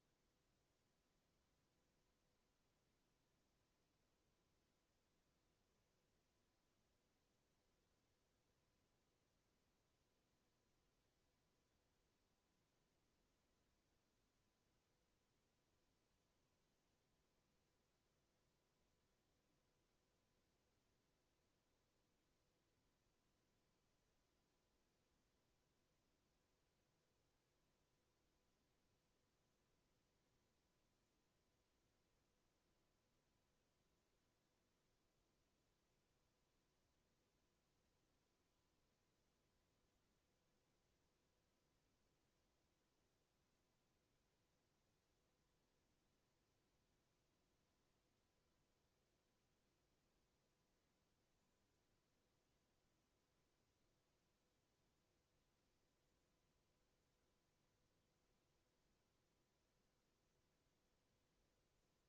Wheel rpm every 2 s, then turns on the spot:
0, 0, 0, 0, 0, 0, 0, 0, 0, 0, 0, 0, 0, 0, 0, 0, 0, 0, 0, 0, 0, 0, 0, 0, 0, 0, 0, 0, 0, 0, 0.
none